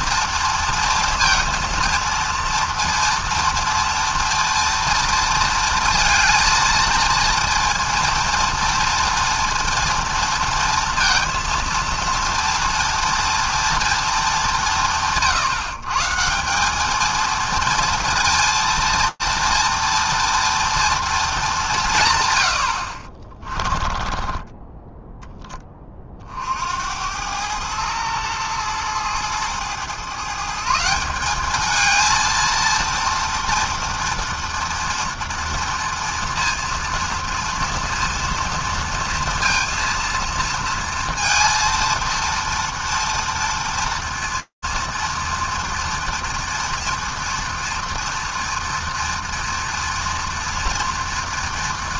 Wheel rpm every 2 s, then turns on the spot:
230, 230, 230, 230, 230, 230, 230, 190, 170, 230, 230, 90, 10, 60, 110, 150, 230, 230, 230, 230, 230, 230, 230, 230, 230, 230.
24-26